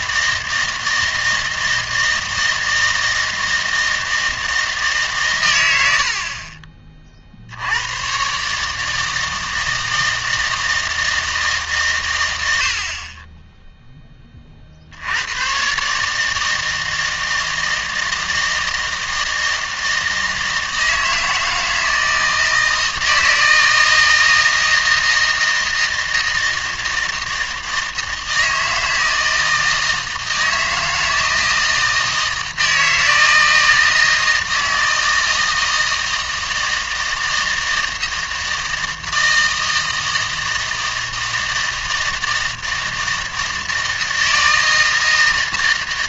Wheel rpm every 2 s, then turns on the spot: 160, 160, 160, 40, 150, 160, 80, 50, 160, 160, 160, 160, 160, 160, 160, 160, 160, 160, 160, 160, 160, 160, 160.
none